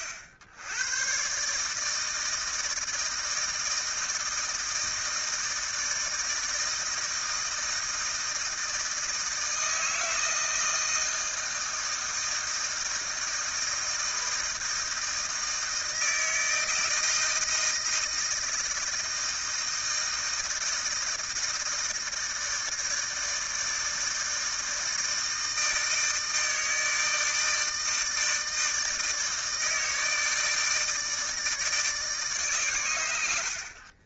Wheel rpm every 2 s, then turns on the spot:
100, 160, 160, 160, 160, 160, 160, 160, 160, 160, 160, 160, 160, 160, 160, 160, 110.
none